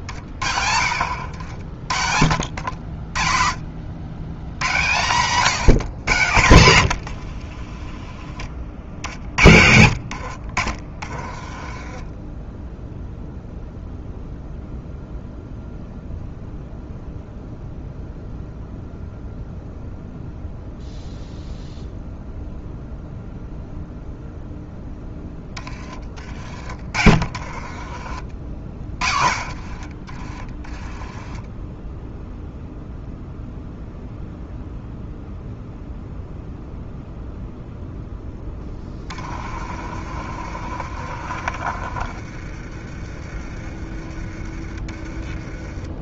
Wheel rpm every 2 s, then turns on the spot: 60, 60, 130, 90, 40, 30, 0, 0, 0, 0, 0, 0, 10, 30, 50, 20, 0, 0, 0, 20, 40, 30, 30.
6-8 10-12 26-32 38-42